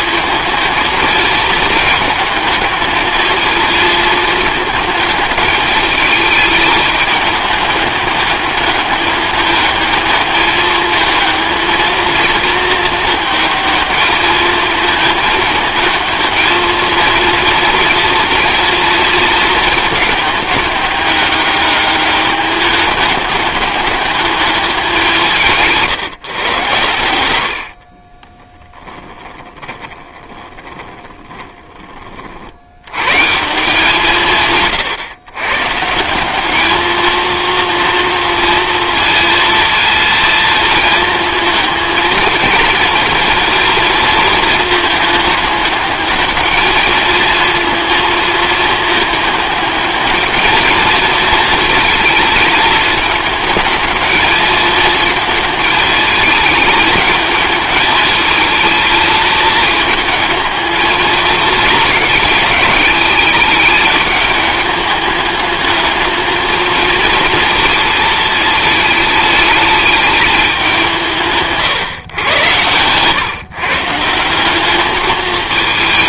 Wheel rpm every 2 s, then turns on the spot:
220, 220, 210, 220, 210, 220, 220, 220, 230, 230, 210, 210, 200, 110, 10, 20, 90, 130, 220, 230, 220, 230, 220, 220, 220, 220, 220, 220, 220, 220, 220, 210, 210, 230, 220, 180, 110, 210.
28-32